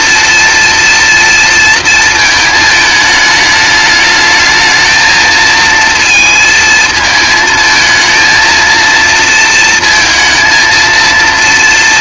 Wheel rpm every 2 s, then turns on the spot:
230, 220, 220, 220, 230, 230.
none